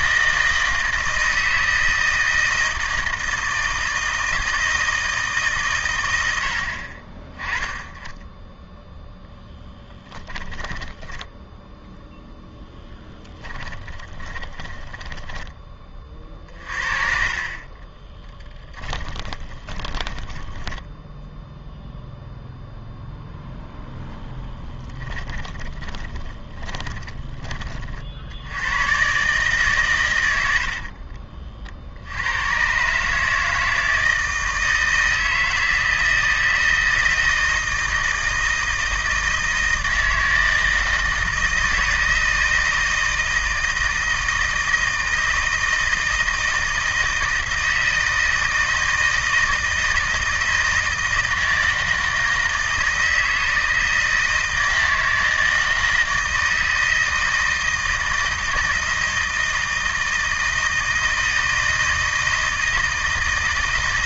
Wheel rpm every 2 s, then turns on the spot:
160, 160, 160, 40, 0, 10, 10, 20, 50, 20, 10, 0, 20, 20, 110, 40, 140, 160, 160, 160, 160, 160, 160, 160, 160, 160, 160, 160, 160, 160, 160, 160.
10-16 18-22 24-28 30-32